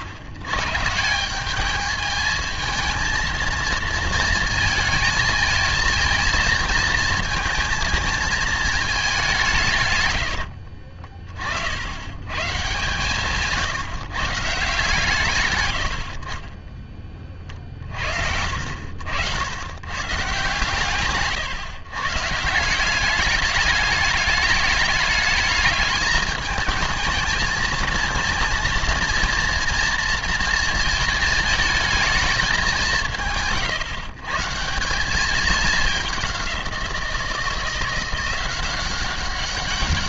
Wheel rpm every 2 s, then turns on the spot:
100, 220, 230, 230, 220, 70, 130, 160, 30, 70, 130, 170, 210, 220, 230, 230, 190, 150, 190, 180.
10-12